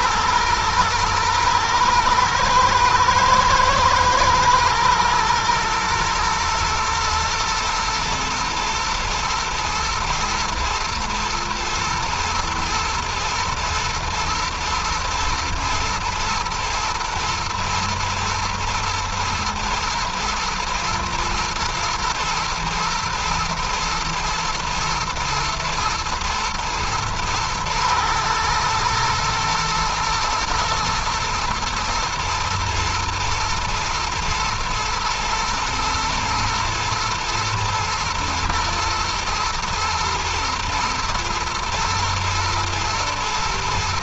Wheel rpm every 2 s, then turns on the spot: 110, 110, 120, 120, 110, 110, 120, 120, 120, 110, 110, 110, 110, 110, 110, 120, 120, 120, 120, 110, 120, 120.
none